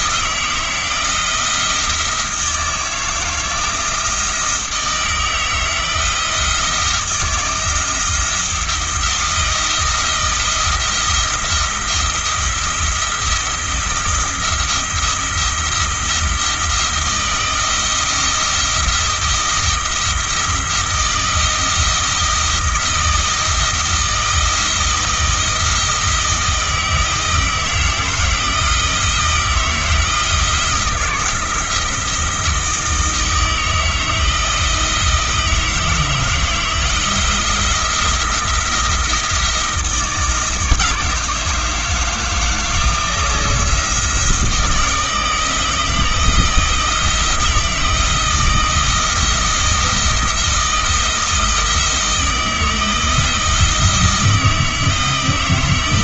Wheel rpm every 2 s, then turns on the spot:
170, 160, 160, 170, 170, 170, 170, 170, 170, 170, 170, 170, 160, 160, 160, 170, 160, 160, 170, 170, 160, 160, 160, 160, 170, 170, 160, 160.
none